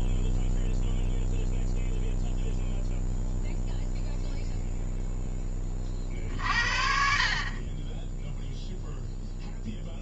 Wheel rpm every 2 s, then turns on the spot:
0, 0, 0, 50, 0.
none